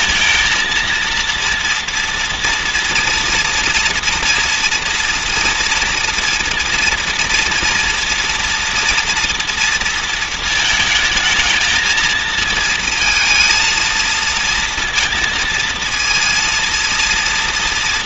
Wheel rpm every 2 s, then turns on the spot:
230, 230, 230, 230, 240, 220, 230, 230, 230.
none